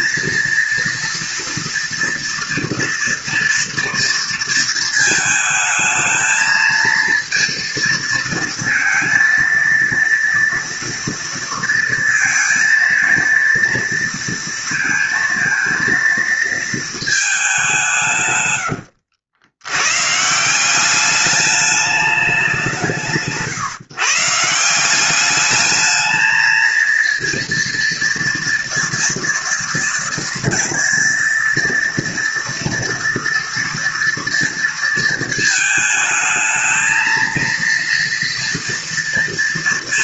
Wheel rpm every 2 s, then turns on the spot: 230, 230, 230, 230, 230, 240, 230, 230, 220, 110, 180, 170, 170, 220, 230, 230, 230, 230, 220, 230.
none